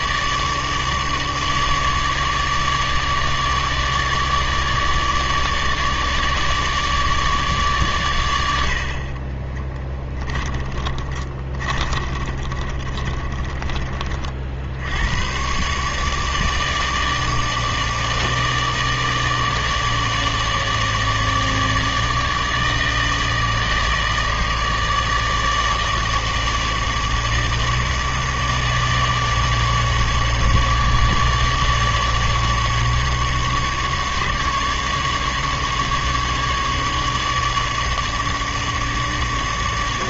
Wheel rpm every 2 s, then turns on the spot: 150, 150, 150, 150, 80, 20, 30, 70, 150, 160, 150, 150, 160, 150, 150, 150, 150, 150, 150, 150.
10-14